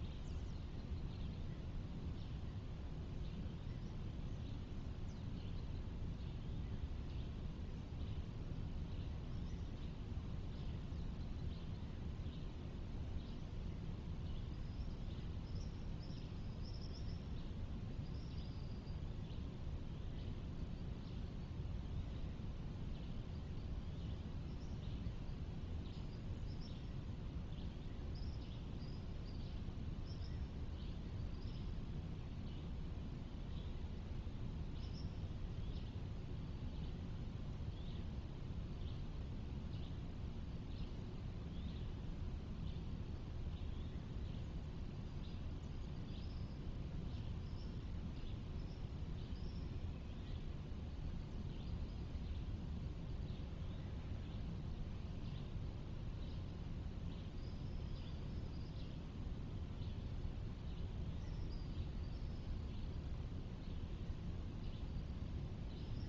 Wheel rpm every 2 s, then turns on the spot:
0, 0, 0, 0, 0, 0, 0, 0, 0, 0, 0, 0, 0, 0, 0, 0, 0, 0, 0, 0, 0, 0, 0, 0, 0, 0, 0, 0, 0, 0, 0, 0, 0.
none